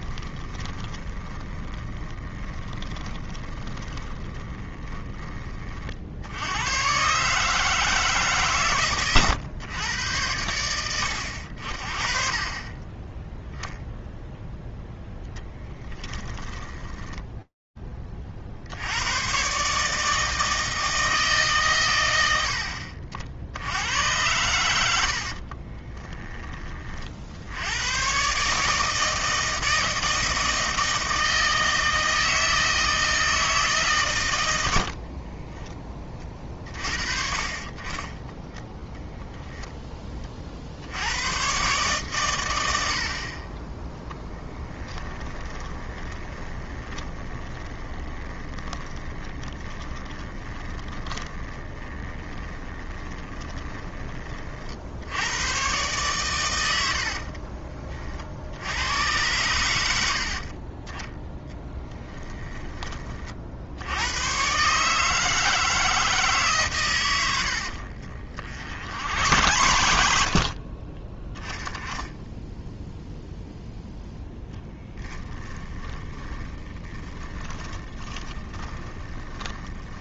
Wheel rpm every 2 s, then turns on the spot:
30, 20, 20, 130, 120, 90, 20, 0, 10, 120, 140, 60, 60, 60, 160, 160, 160, 50, 40, 0, 110, 50, 20, 20, 20, 20, 20, 70, 70, 90, 20, 20, 140, 130, 90, 30, 0, 10, 20, 20.
0-6 24-26 34-36 44-54 68-70 74-80